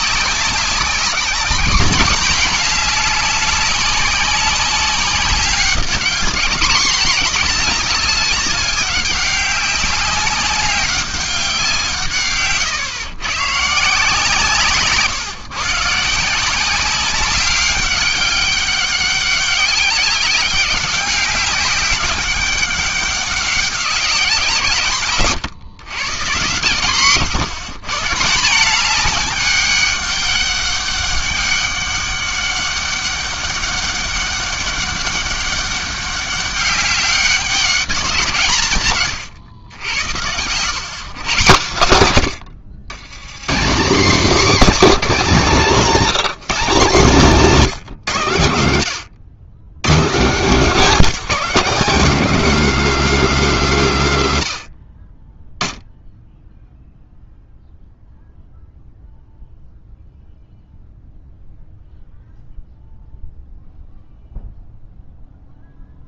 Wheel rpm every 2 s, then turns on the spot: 190, 190, 190, 200, 190, 200, 130, 140, 190, 200, 190, 200, 140, 130, 200, 200, 200, 200, 200, 140, 130, 90, 220, 180, 110, 220, 240, 30, 0, 0, 0, 0, 0.
26-28 38-40